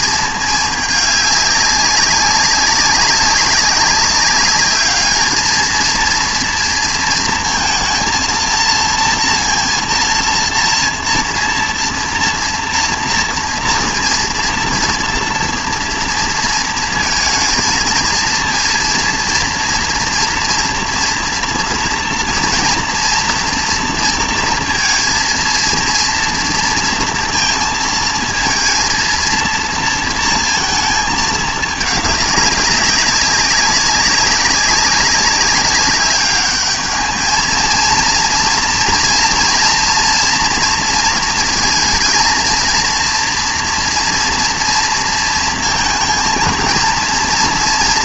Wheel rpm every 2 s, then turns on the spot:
210, 190, 200, 230, 230, 230, 230, 230, 230, 230, 230, 230, 230, 230, 230, 220, 190, 190, 210, 240, 230, 230, 230, 220.
none